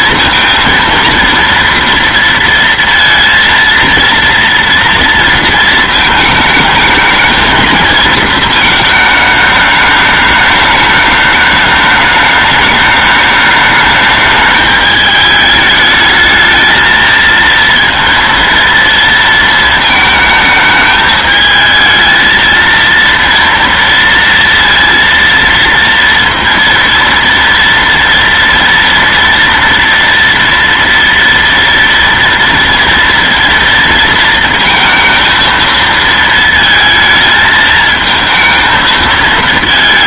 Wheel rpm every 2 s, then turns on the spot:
230, 230, 230, 220, 220, 210, 210, 210, 220, 230, 220, 230, 230, 230, 230, 230, 230, 230, 230, 220.
none